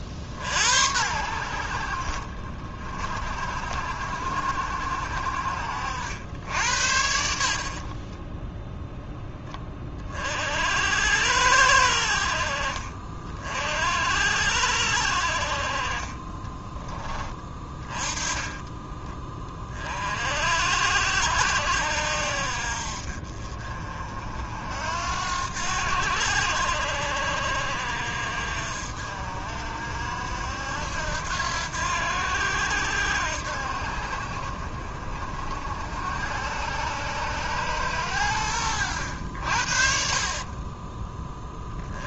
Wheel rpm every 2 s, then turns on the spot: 80, 50, 60, 80, 0, 80, 40, 60, 20, 20, 70, 50, 80, 60, 60, 80, 80, 50, 90, 80, 20.
40-42